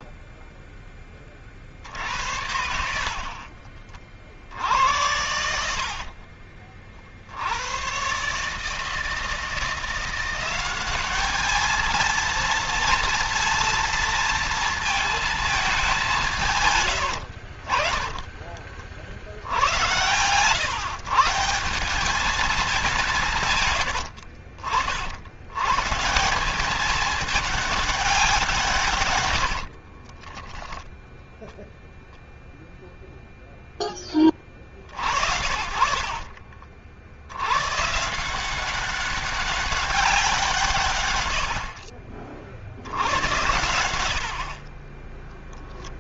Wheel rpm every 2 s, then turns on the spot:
30, 70, 80, 60, 160, 200, 230, 220, 80, 60, 140, 180, 80, 200, 100, 0, 0, 50, 70, 200, 110, 80, 10.
16-18 28-30 40-42